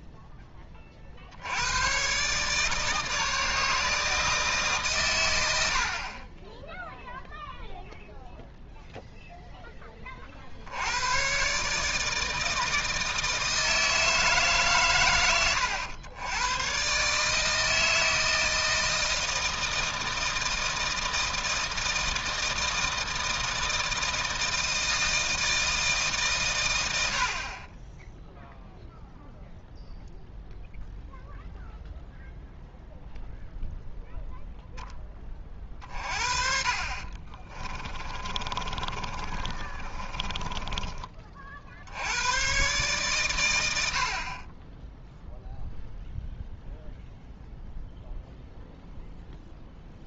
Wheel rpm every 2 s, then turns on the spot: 30, 150, 150, 10, 0, 70, 160, 140, 120, 160, 160, 160, 160, 100, 0, 0, 0, 0, 40, 30, 20, 130, 10, 0, 0.
36-42